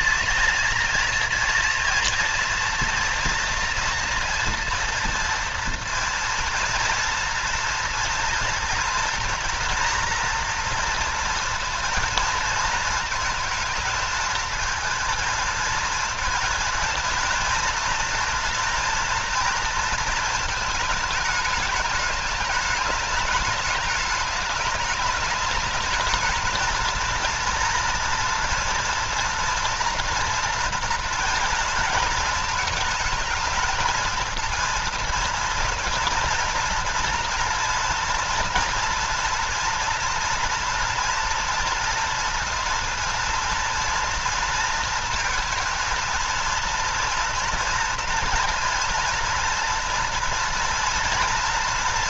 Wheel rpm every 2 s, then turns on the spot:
230, 240, 230, 230, 240, 240, 230, 220, 230, 230, 220, 210, 210, 220, 240, 230, 220, 230, 230, 230, 230, 230, 230, 230, 240, 240.
none